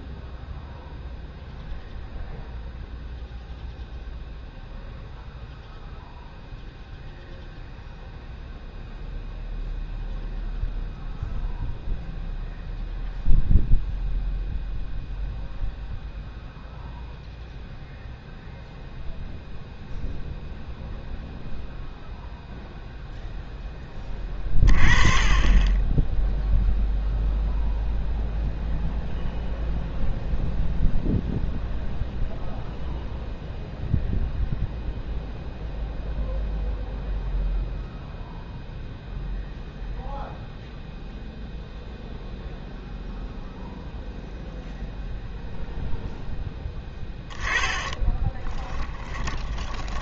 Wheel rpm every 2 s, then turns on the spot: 0, 0, 0, 0, 0, 0, 0, 0, 0, 0, 0, 0, 20, 0, 0, 0, 0, 0, 0, 0, 0, 0, 0, 10, 10.
48-50